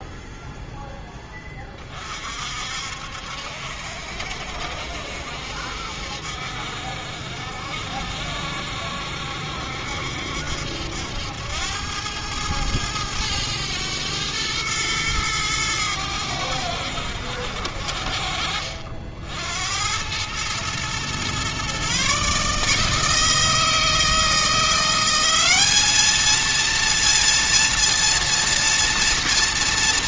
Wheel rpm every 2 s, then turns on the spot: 10, 60, 70, 60, 70, 80, 100, 110, 70, 70, 120, 160, 190, 230, 230.
none